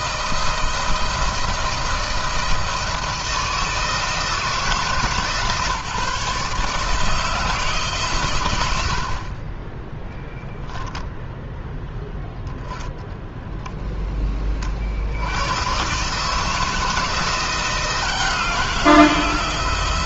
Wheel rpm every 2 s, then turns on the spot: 160, 160, 150, 150, 70, 0, 10, 60, 160, 170.
none